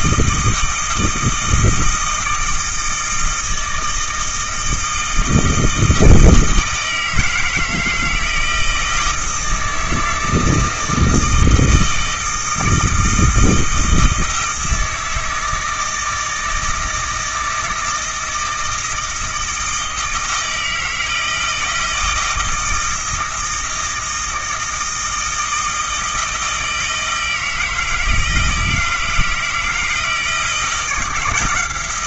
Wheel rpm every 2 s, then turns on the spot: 160, 160, 160, 160, 160, 160, 160, 160, 160, 160, 160, 160, 160, 160, 160, 170.
none